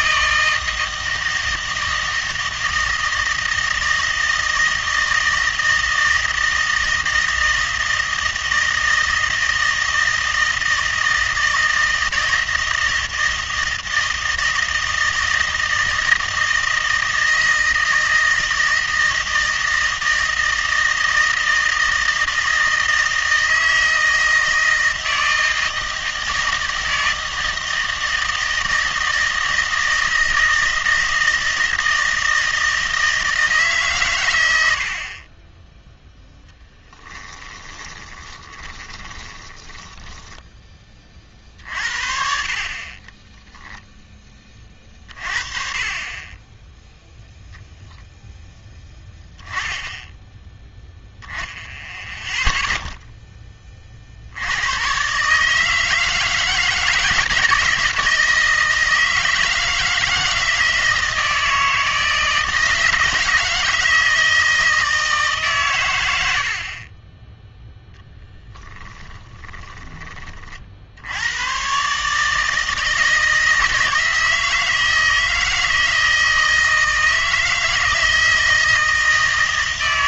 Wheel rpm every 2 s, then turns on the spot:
160, 160, 160, 160, 160, 160, 160, 160, 160, 160, 160, 160, 160, 160, 160, 160, 160, 90, 10, 20, 20, 50, 30, 0, 10, 10, 0, 90, 150, 160, 160, 160, 160, 50, 10, 50, 160, 160, 160, 160.
36-40 68-70